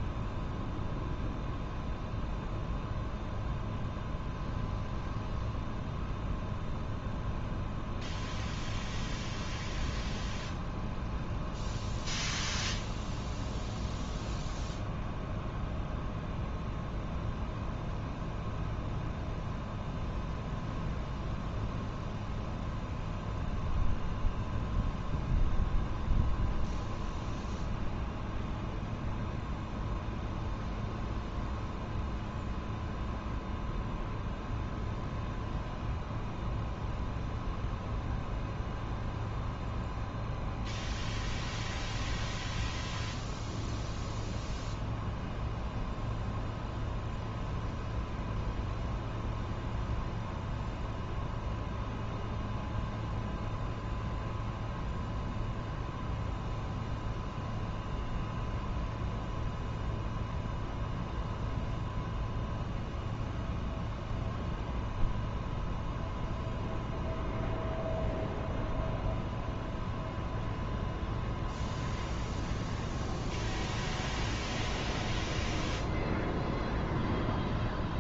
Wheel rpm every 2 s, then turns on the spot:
0, 0, 0, 0, 0, 0, 0, 0, 0, 0, 0, 0, 0, 0, 0, 0, 0, 0, 0, 0, 0, 0, 0, 0, 0, 0, 0, 0, 0, 0, 0, 0, 0, 0, 0, 0, 0, 0, 0.
none